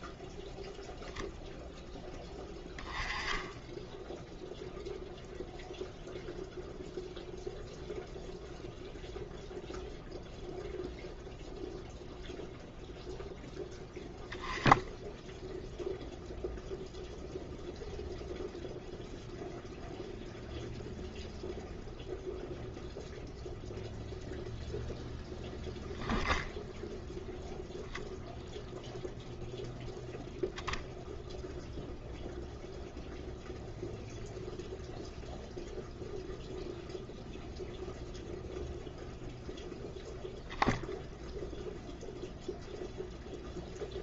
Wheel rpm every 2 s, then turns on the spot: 0, 10, 0, 0, 0, 0, 0, 10, 0, 0, 0, 0, 0, 0, 0, 0, 0, 0, 0, 0, 0, 0.
none